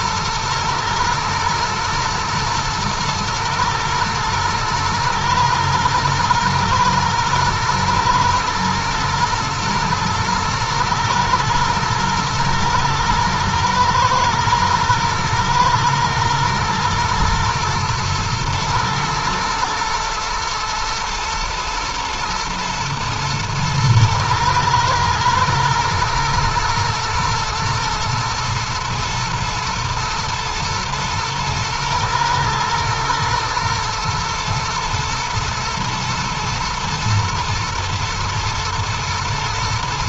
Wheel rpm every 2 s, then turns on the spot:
110, 110, 110, 110, 110, 110, 110, 110, 120, 110, 110, 110, 110, 120, 110, 120, 110, 110, 110, 120.
none